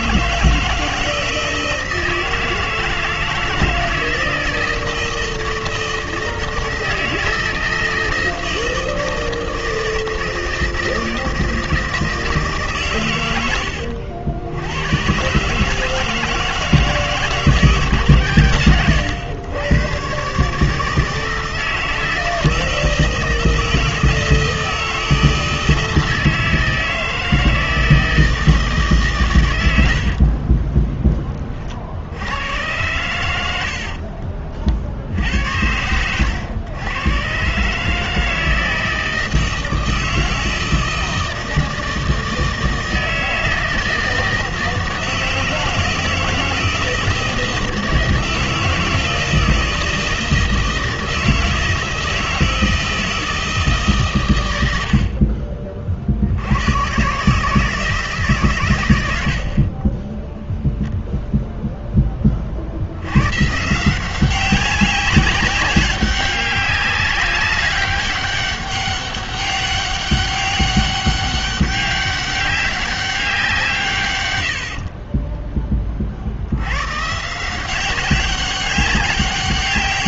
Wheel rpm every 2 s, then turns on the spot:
160, 160, 160, 160, 160, 160, 120, 110, 160, 110, 160, 160, 160, 160, 150, 30, 100, 60, 110, 160, 160, 160, 160, 160, 160, 160, 160, 70, 120, 100, 0, 80, 190, 200, 200, 200, 190, 30, 130, 190.
30-32 74-76